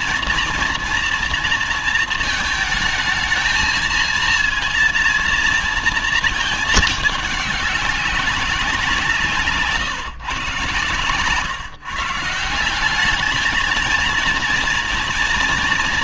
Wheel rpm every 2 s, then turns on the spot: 240, 220, 230, 220, 190, 130, 170, 230.
none